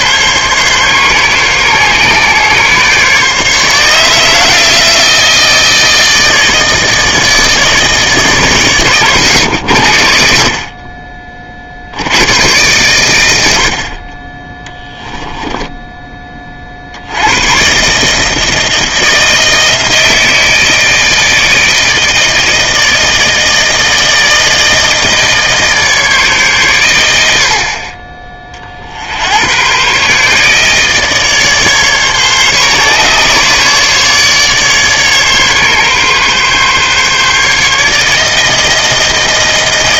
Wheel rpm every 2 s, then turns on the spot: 140, 140, 160, 160, 130, 50, 100, 10, 40, 160, 160, 160, 160, 130, 40, 150, 140, 150, 140, 160.
none